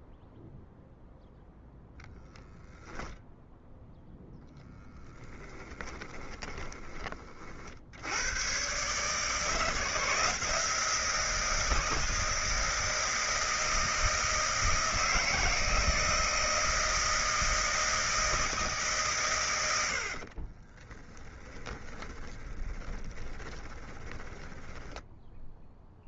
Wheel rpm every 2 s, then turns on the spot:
0, 0, 10, 20, 110, 160, 160, 160, 160, 160, 30, 20, 10.
6-8 20-24